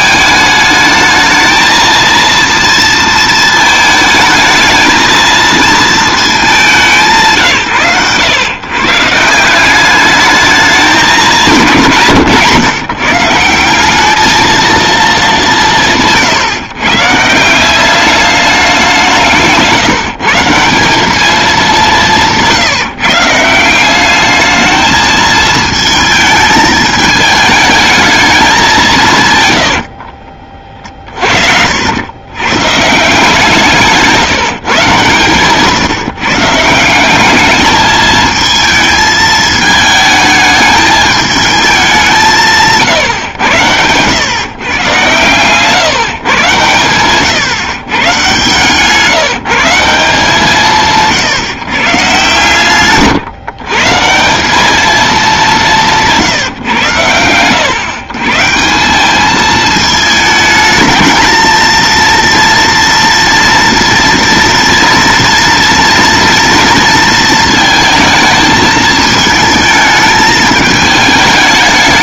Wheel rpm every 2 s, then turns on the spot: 220, 230, 220, 150, 160, 200, 150, 210, 150, 160, 210, 160, 220, 220, 130, 40, 150, 150, 180, 220, 210, 130, 130, 120, 160, 170, 130, 210, 120, 190, 220, 230, 230, 230, 220, 220.
42-44 52-54